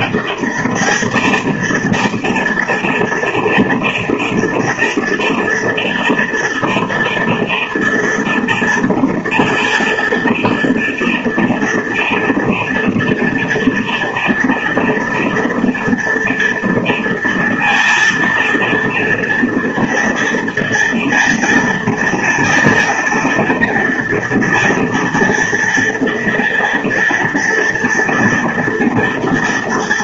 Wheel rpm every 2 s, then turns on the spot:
210, 230, 230, 230, 230, 230, 230, 240, 230, 230, 230, 230, 230, 230, 230.
none